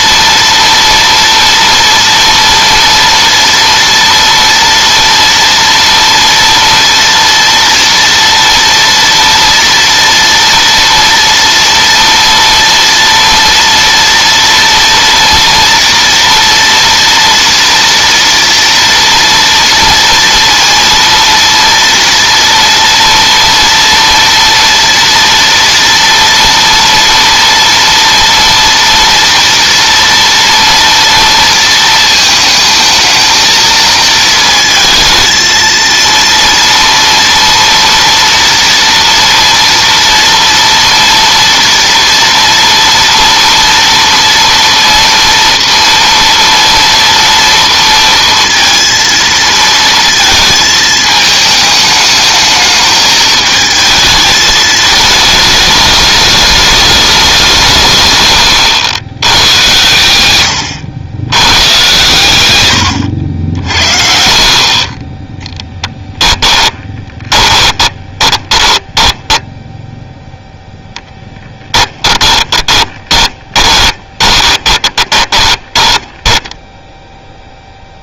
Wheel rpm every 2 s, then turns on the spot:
230, 230, 230, 230, 230, 230, 230, 230, 240, 230, 230, 230, 230, 230, 230, 230, 220, 230, 230, 230, 230, 230, 230, 230, 230, 220, 210, 220, 210, 100, 90, 100, 30, 20, 20, 0, 30, 20, 0.
66-70 72-76